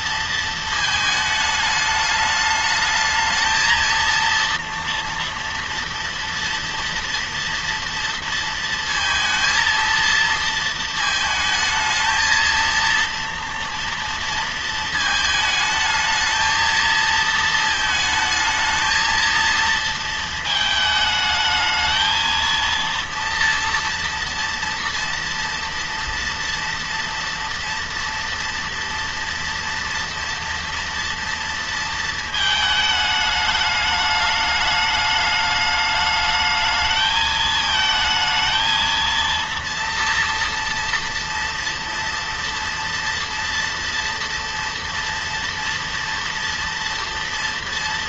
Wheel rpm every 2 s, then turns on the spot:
220, 210, 230, 230, 230, 220, 220, 230, 220, 220, 220, 230, 230, 230, 230, 240, 220, 210, 220, 220, 230, 230, 230, 230.
none